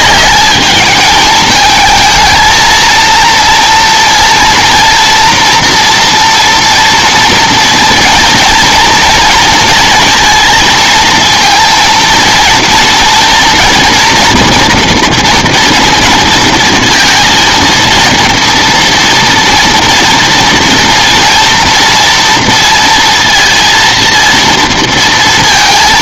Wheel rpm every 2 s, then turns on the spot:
210, 230, 230, 240, 230, 230, 230, 230, 230, 230, 230, 230, 230.
none